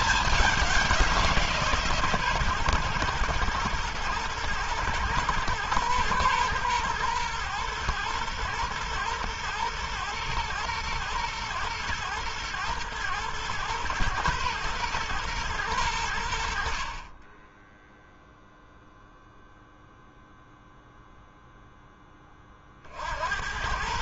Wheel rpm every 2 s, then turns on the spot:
180, 120, 120, 120, 120, 120, 110, 120, 40, 0, 0, 60.
none